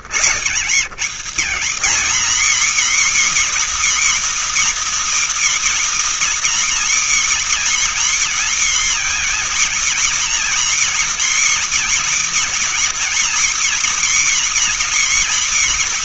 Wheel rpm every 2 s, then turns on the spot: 160, 290, 330, 310, 290, 290, 300, 300.
none